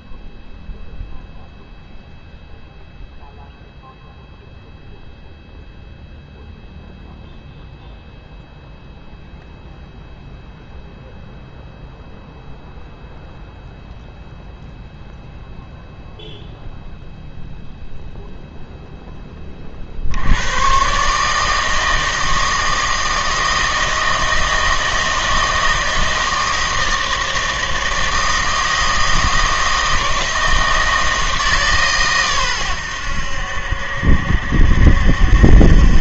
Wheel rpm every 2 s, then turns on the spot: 0, 0, 0, 0, 0, 0, 0, 0, 0, 0, 110, 160, 160, 160, 160, 160, 110, 70.
none